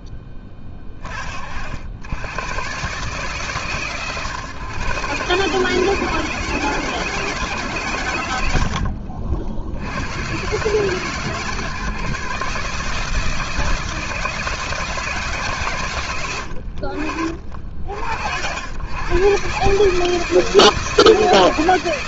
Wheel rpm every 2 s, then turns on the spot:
30, 140, 140, 160, 60, 140, 160, 150, 40, 110, 170.
none